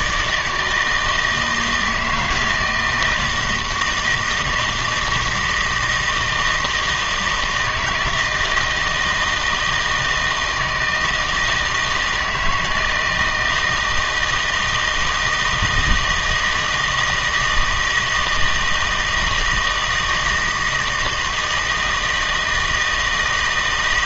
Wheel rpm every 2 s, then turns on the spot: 160, 160, 170, 160, 160, 160, 160, 160, 160, 160, 160, 160.
none